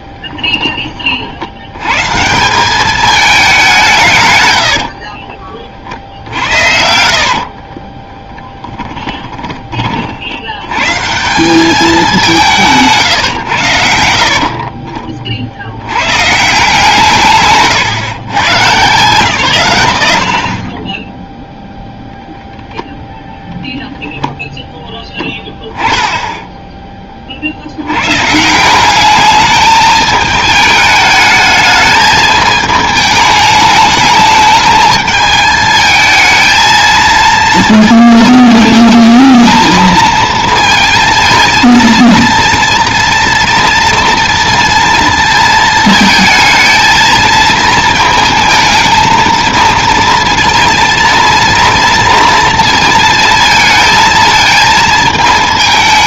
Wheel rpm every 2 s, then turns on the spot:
20, 200, 60, 70, 30, 130, 150, 40, 160, 140, 10, 0, 10, 20, 190, 210, 220, 210, 230, 220, 220, 230, 230, 230, 220, 230, 230, 220.
4-10 16-18 20-22